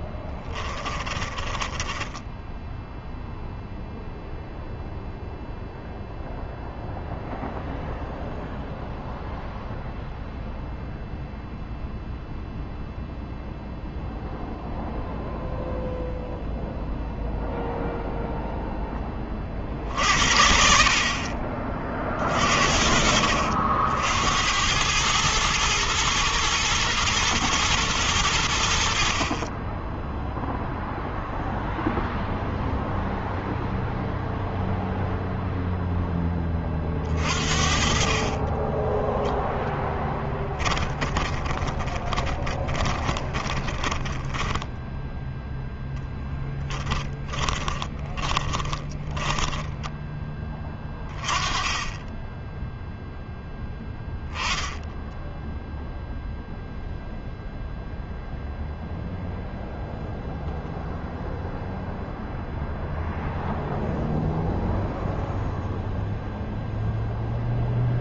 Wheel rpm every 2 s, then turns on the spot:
10, 10, 0, 0, 0, 0, 0, 0, 0, 0, 60, 40, 80, 110, 90, 0, 0, 0, 10, 30, 20, 20, 10, 10, 20, 10, 10, 0, 0, 0, 0, 0, 0, 0.
0-4 38-50